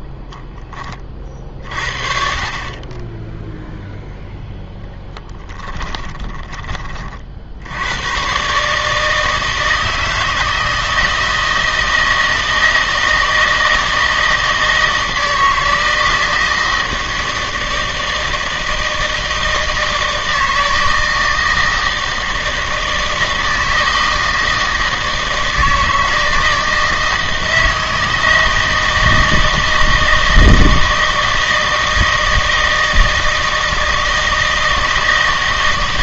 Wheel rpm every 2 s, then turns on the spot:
10, 40, 0, 20, 140, 160, 160, 160, 160, 160, 160, 160, 160, 160, 160, 160, 160, 160.
none